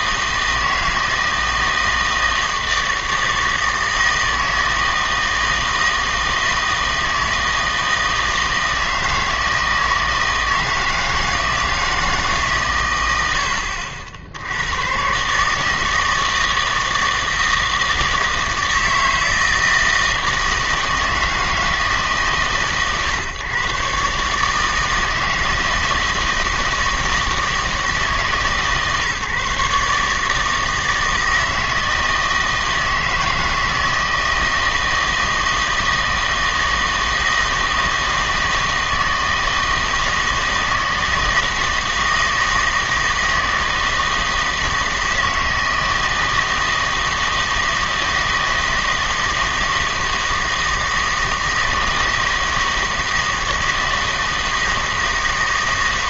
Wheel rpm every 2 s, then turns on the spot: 160, 160, 160, 160, 160, 160, 100, 110, 160, 160, 160, 130, 160, 160, 150, 160, 160, 160, 160, 160, 160, 160, 160, 160, 160, 160, 160, 160.
none